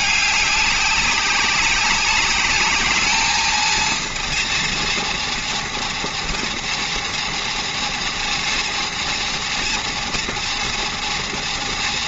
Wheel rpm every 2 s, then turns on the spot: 200, 210, 230, 230, 230, 230.
none